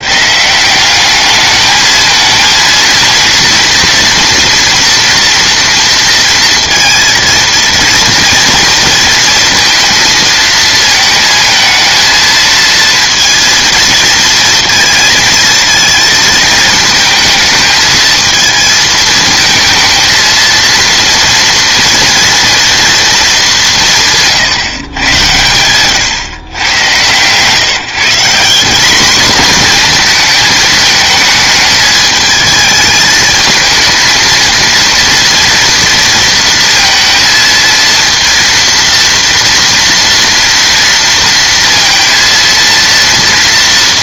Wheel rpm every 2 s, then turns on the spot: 170, 220, 240, 230, 230, 220, 230, 230, 220, 220, 230, 230, 140, 120, 200, 220, 220, 230, 230, 230, 230, 230.
none